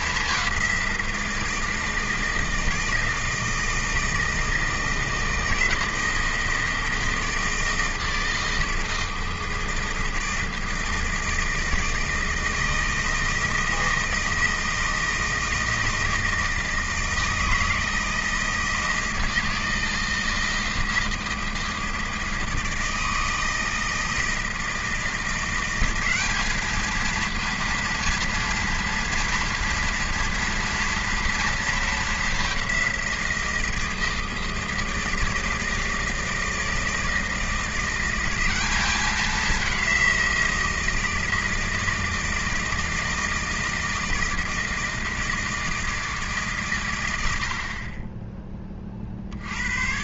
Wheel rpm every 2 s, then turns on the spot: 190, 160, 160, 160, 160, 160, 160, 160, 160, 160, 160, 160, 160, 210, 230, 230, 190, 160, 160, 190, 170, 160, 160, 130, 20.
none